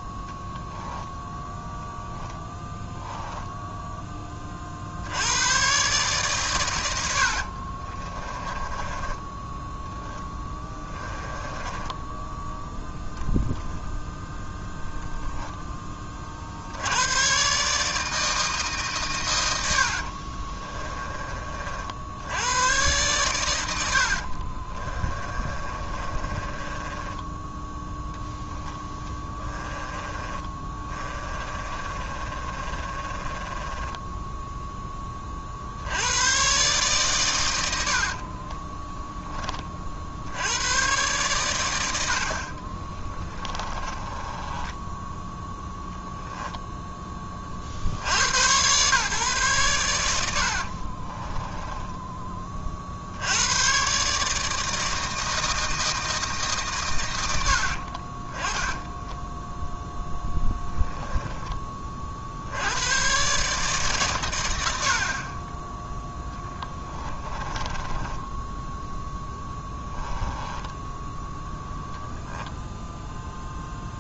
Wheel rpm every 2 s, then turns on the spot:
10, 0, 40, 110, 20, 10, 0, 0, 70, 140, 30, 110, 30, 20, 10, 20, 30, 10, 130, 10, 100, 40, 10, 10, 130, 40, 40, 160, 130, 10, 10, 80, 90, 10, 10, 10, 10.
8-12 20-22 24-28 30-34 38-40 42-46 50-52 58-62 66-72